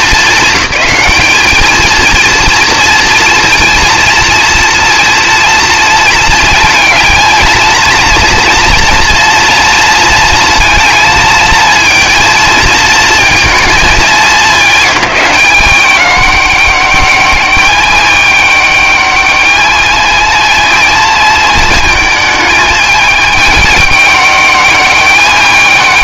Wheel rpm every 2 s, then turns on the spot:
210, 230, 230, 230, 240, 230, 220, 200, 200, 210, 230, 220, 200.
none